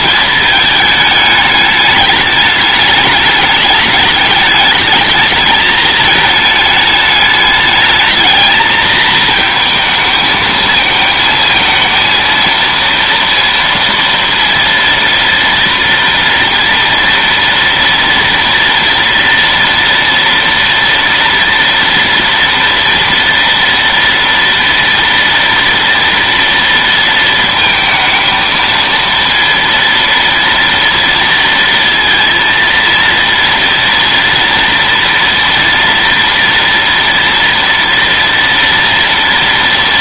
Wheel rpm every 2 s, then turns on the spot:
220, 210, 220, 210, 220, 220, 230, 230, 230, 230, 230, 230, 230, 230, 230, 230, 230, 230, 230, 230.
none